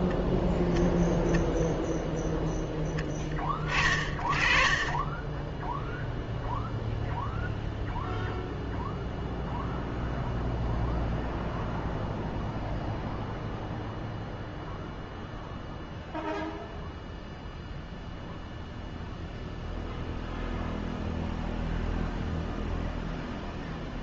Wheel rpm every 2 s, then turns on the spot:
0, 0, 30, 0, 0, 0, 0, 0, 0, 0, 0, 0.
none